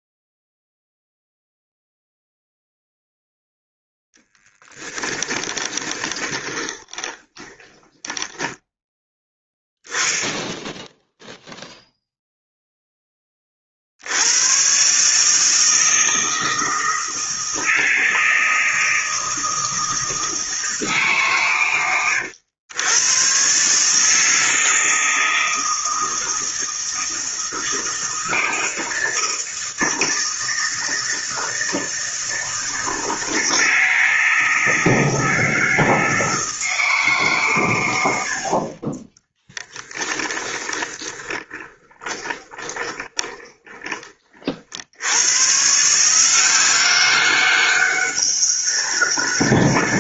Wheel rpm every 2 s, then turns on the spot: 0, 0, 10, 20, 10, 0, 0, 120, 160, 160, 160, 100, 160, 160, 160, 160, 160, 160, 160, 40, 30, 20, 50, 180, 200.
4-10 40-44